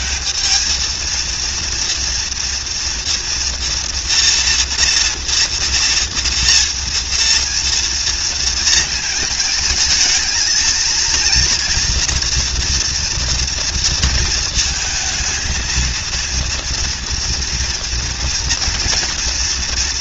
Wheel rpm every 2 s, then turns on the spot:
220, 230, 240, 230, 230, 230, 230, 220, 230, 230.
none